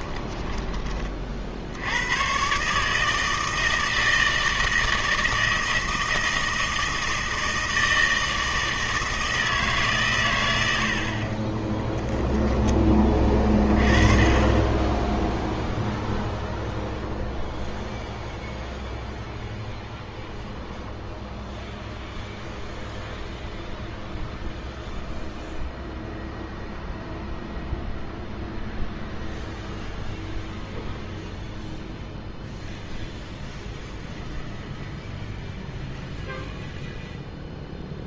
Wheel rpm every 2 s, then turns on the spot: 20, 140, 160, 160, 160, 90, 20, 20, 0, 0, 0, 0, 0, 0, 0, 0, 0, 0, 0.
10-14